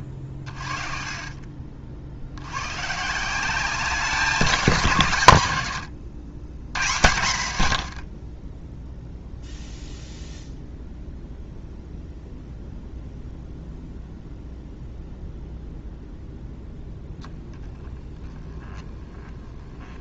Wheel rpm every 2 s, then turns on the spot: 30, 110, 170, 120, 10, 0, 0, 0, 10, 20.
none